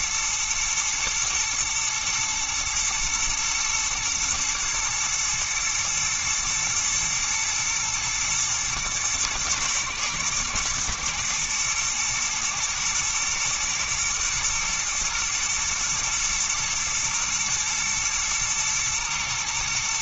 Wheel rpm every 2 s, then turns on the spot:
110, 110, 110, 110, 110, 120, 110, 120, 120, 110.
none